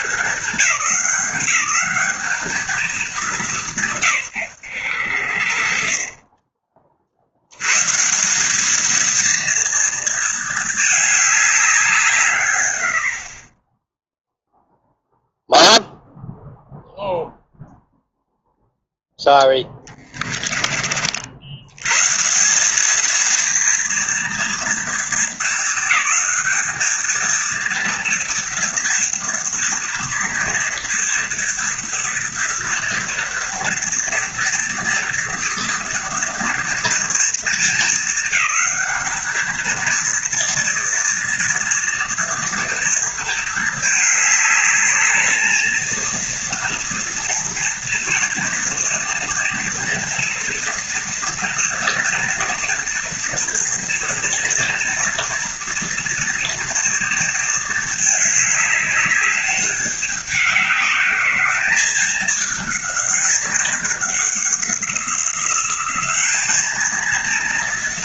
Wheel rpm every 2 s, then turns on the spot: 200, 220, 100, 40, 220, 220, 90, 0, 0, 0, 30, 200, 230, 220, 230, 230, 240, 230, 230, 220, 230, 230, 210, 230, 230, 230, 230, 230, 230, 210, 200, 210, 190, 220.
none